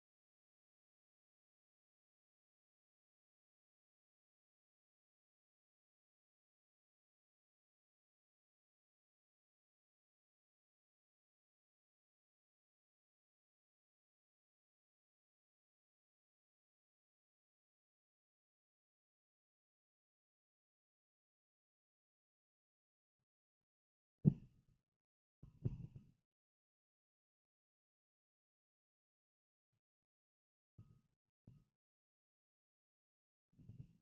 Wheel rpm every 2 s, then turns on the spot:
0, 0, 0, 0, 0, 0, 0, 0, 0, 0, 0, 0, 0, 0, 0, 0, 0.
none